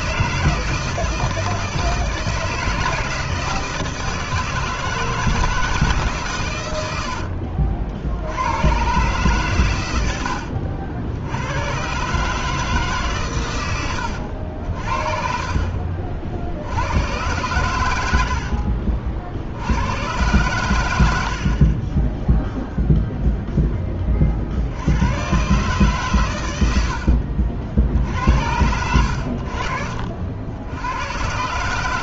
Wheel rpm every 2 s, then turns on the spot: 160, 160, 160, 110, 100, 70, 150, 70, 70, 60, 110, 0, 60, 110, 70, 70.
18-20